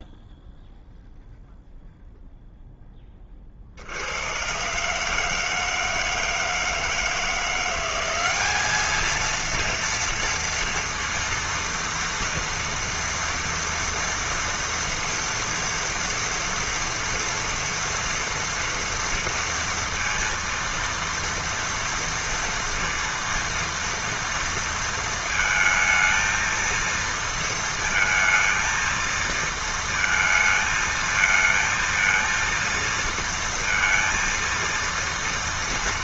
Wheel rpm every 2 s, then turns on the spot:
0, 20, 150, 170, 230, 230, 230, 230, 230, 230, 230, 230, 230, 230, 230, 220, 230, 230.
none